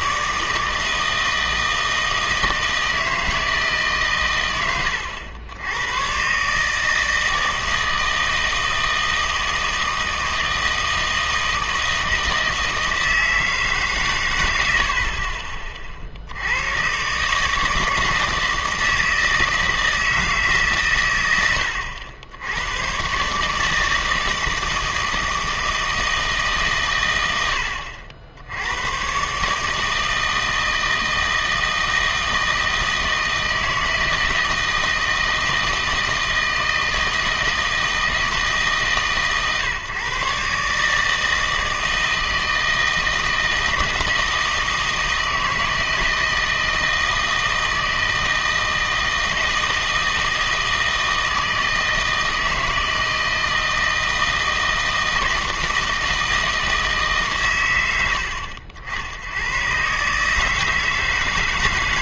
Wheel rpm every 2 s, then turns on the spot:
160, 160, 100, 150, 160, 160, 160, 80, 110, 160, 140, 100, 160, 130, 100, 160, 160, 170, 160, 150, 150, 160, 160, 160, 160, 160, 160, 160, 160, 70, 160.
none